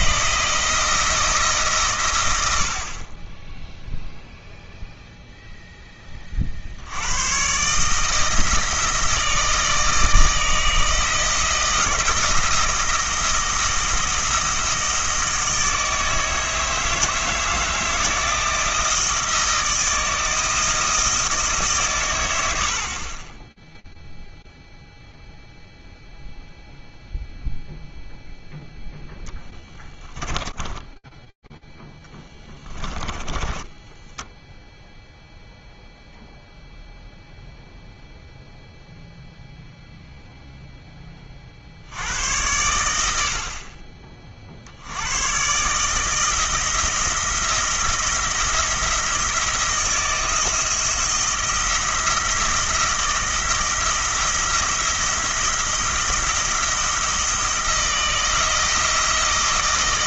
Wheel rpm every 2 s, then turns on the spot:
170, 80, 0, 50, 160, 160, 170, 160, 160, 160, 160, 80, 0, 0, 0, 10, 20, 0, 0, 0, 60, 60, 150, 170, 160, 170, 170, 170, 170, 160.
30-34